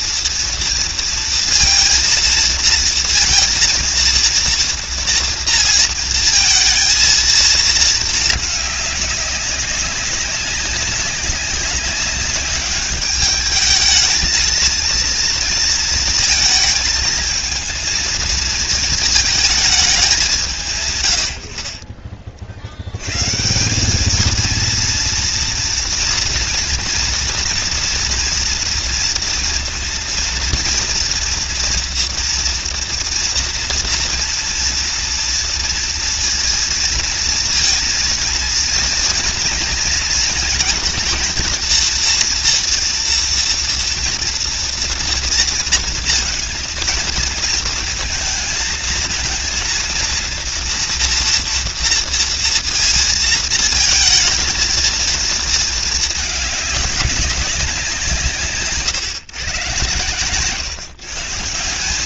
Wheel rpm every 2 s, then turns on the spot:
240, 230, 230, 230, 210, 190, 200, 230, 230, 220, 160, 60, 230, 230, 230, 230, 240, 230, 230, 230, 230, 230, 230, 230, 230, 240, 230, 230, 210, 150, 140.
none